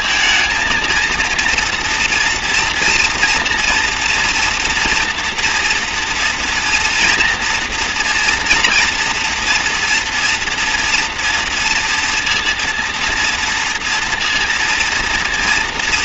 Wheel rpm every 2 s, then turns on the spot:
230, 230, 230, 230, 240, 240, 230, 230.
none